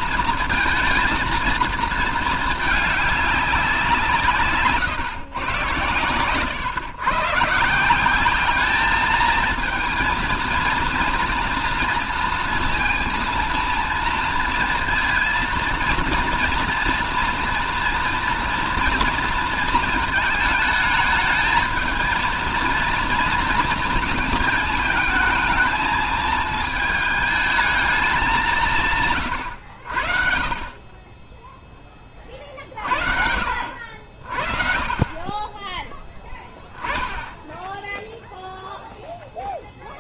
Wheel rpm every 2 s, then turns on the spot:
230, 220, 140, 120, 200, 230, 230, 230, 230, 230, 220, 230, 220, 220, 190, 50, 40, 50, 10, 10.
none